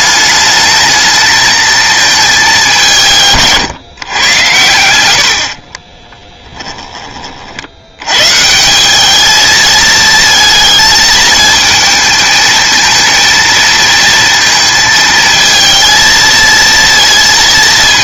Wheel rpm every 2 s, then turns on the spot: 210, 210, 110, 10, 170, 230, 220, 220, 230.
6-8